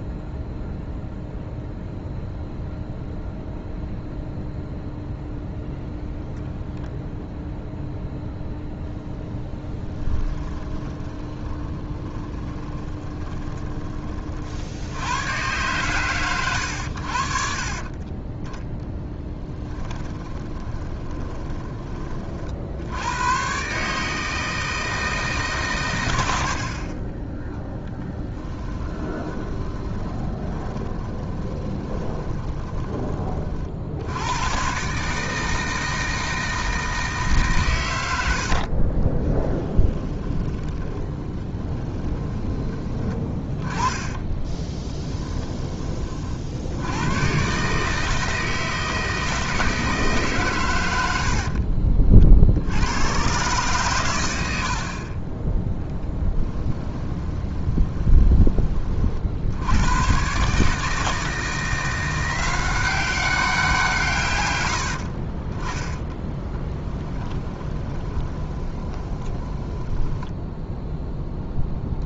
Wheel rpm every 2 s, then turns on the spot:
0, 0, 0, 0, 0, 20, 20, 80, 90, 10, 20, 70, 160, 40, 20, 20, 20, 120, 160, 40, 20, 20, 20, 80, 160, 100, 90, 60, 20, 40, 150, 190, 90, 10, 20, 0.
10-14 20-22 26-34 38-42 44-46 54-58 66-70